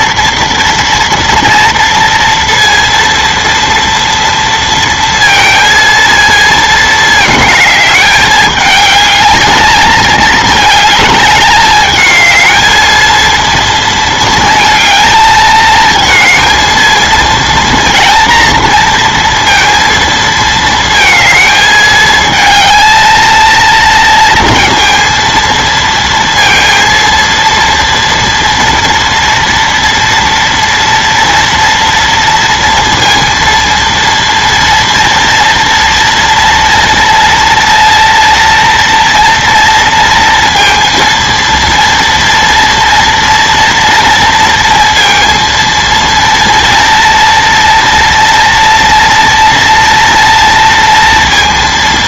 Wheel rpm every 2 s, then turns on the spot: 230, 230, 230, 220, 220, 220, 220, 220, 230, 230, 220, 220, 230, 230, 230, 230, 230, 230, 230, 230, 230, 230, 230, 230, 230, 230.
none